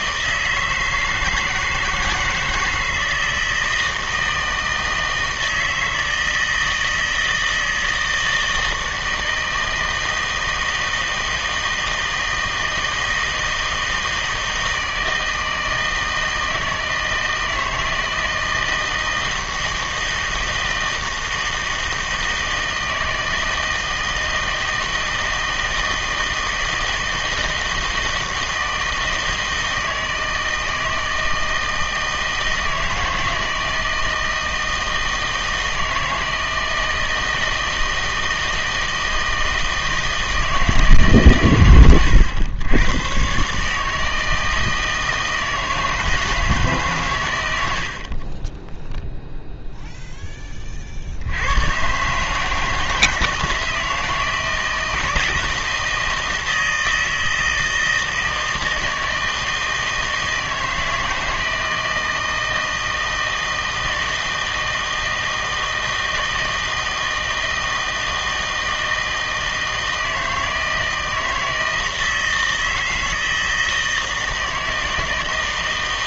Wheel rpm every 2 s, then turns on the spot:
160, 160, 160, 160, 160, 160, 160, 160, 160, 160, 160, 160, 160, 160, 160, 160, 160, 160, 160, 160, 160, 100, 160, 150, 10, 30, 160, 160, 160, 160, 160, 160, 160, 160, 160, 160, 160, 160.
none